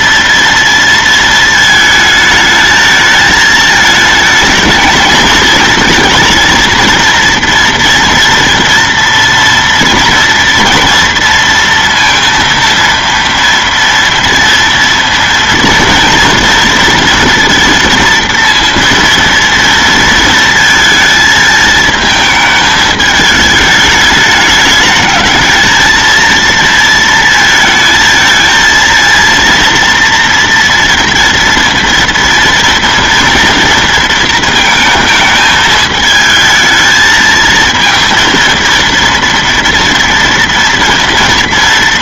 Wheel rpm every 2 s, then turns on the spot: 230, 220, 220, 230, 230, 230, 230, 230, 230, 230, 220, 220, 210, 230, 230, 230, 230, 220, 220, 230, 230.
none